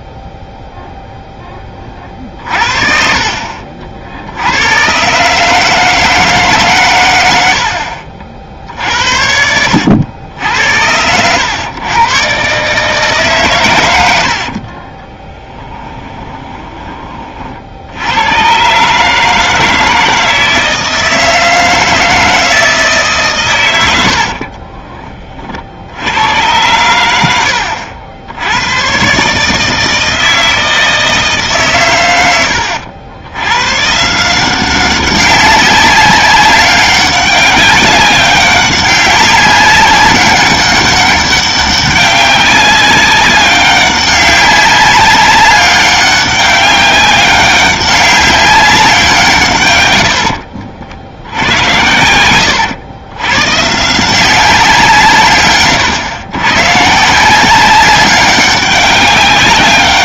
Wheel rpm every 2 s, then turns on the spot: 0, 40, 120, 120, 60, 80, 140, 40, 20, 140, 160, 160, 30, 100, 110, 160, 80, 190, 200, 190, 200, 190, 200, 200, 190, 70, 100, 170, 140, 200.
14-16 24-26